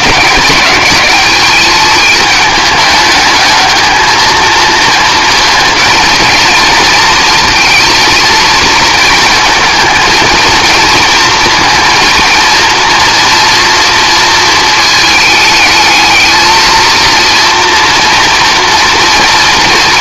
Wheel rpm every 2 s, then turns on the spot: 200, 210, 230, 230, 230, 230, 230, 220, 230, 230.
none